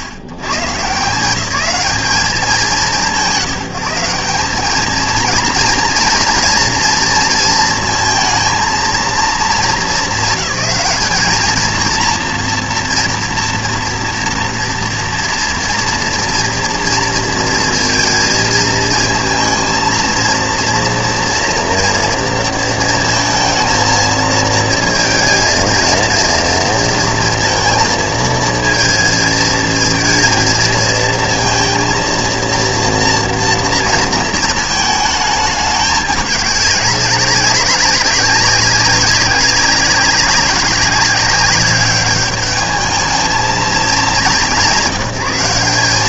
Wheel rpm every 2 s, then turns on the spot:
140, 190, 170, 230, 230, 220, 230, 240, 230, 220, 230, 230, 230, 230, 230, 230, 230, 220, 200, 200, 190, 210, 190.
none